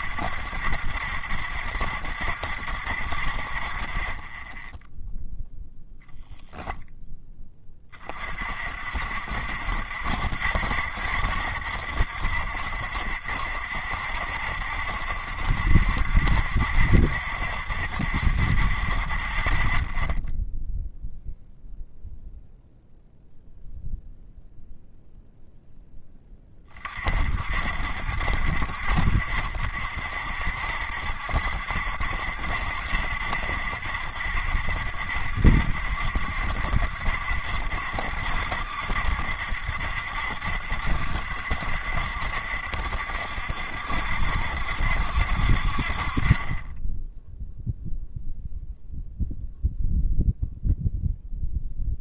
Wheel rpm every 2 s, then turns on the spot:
70, 70, 10, 0, 50, 80, 70, 70, 70, 50, 0, 0, 0, 30, 60, 60, 70, 70, 70, 70, 70, 70, 70, 10, 0, 0.
none